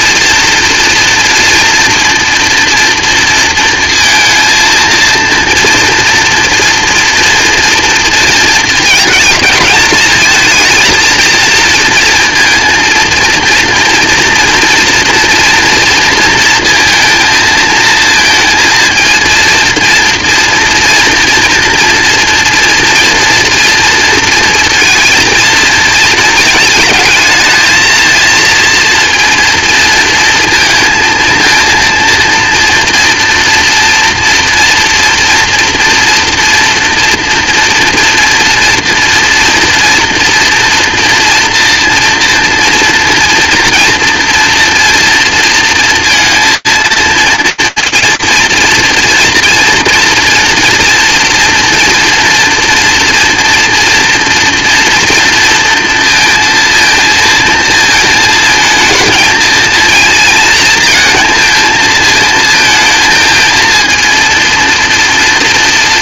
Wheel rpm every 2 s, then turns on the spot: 230, 230, 230, 240, 220, 220, 230, 240, 230, 230, 230, 230, 230, 220, 230, 230, 230, 230, 230, 230, 230, 230, 240, 230, 240, 230, 230, 230, 230, 220, 230, 230, 230.
none